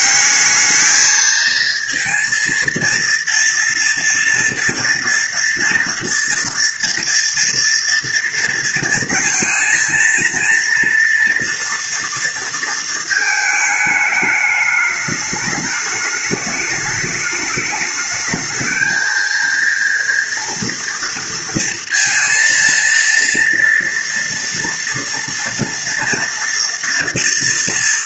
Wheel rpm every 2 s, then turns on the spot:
210, 230, 240, 230, 230, 230, 230, 210, 210, 220, 230, 230, 230, 230.
none